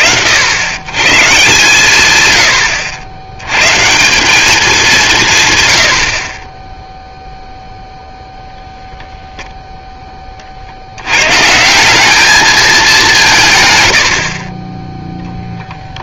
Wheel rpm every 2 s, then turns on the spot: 60, 120, 170, 60, 0, 60, 210, 20.
14-16